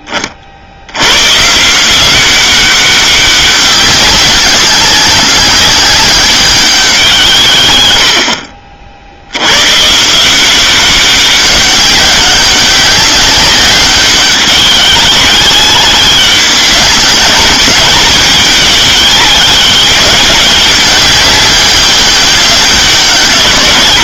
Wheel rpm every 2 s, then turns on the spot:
50, 190, 200, 200, 50, 180, 190, 190, 190, 210, 200, 200.
none